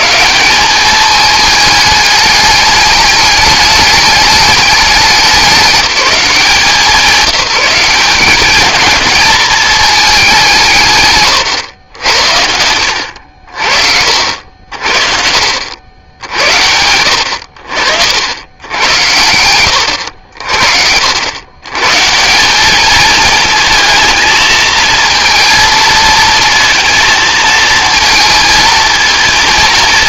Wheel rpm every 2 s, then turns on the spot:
200, 210, 210, 180, 220, 160, 90, 60, 80, 90, 80, 220, 230, 230, 230.
none